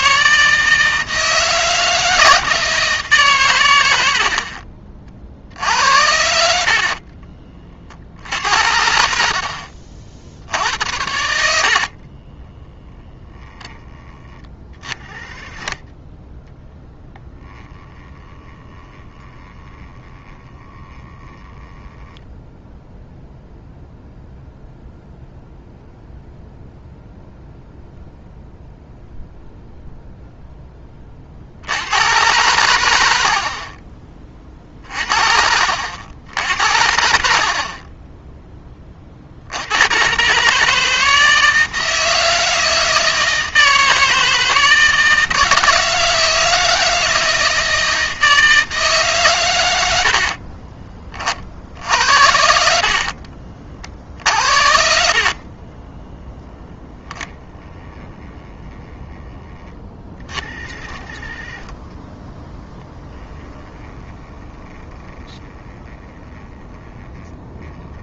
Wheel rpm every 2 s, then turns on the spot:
160, 160, 40, 50, 70, 80, 10, 30, 10, 10, 10, 0, 0, 0, 0, 20, 80, 40, 70, 40, 160, 160, 160, 160, 140, 30, 50, 60, 10, 10, 40, 10, 10, 10.
6-8 52-56